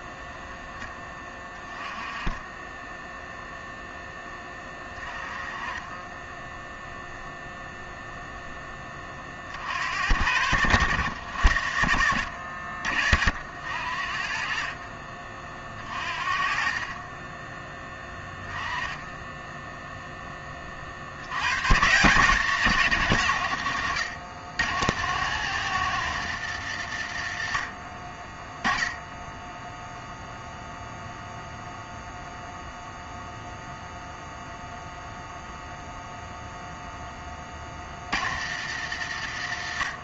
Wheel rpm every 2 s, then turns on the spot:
10, 10, 20, 0, 10, 90, 60, 40, 40, 10, 30, 170, 110, 110, 10, 0, 0, 0, 0, 90.
none